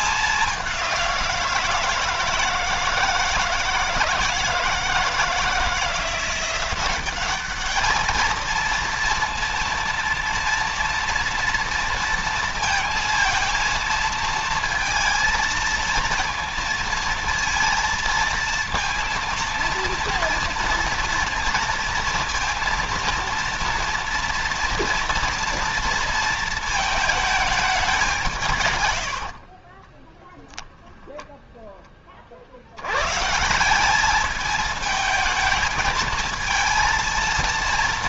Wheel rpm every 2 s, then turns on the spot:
200, 160, 160, 180, 220, 230, 230, 230, 230, 230, 230, 230, 230, 230, 150, 10, 70, 220, 230.
28-30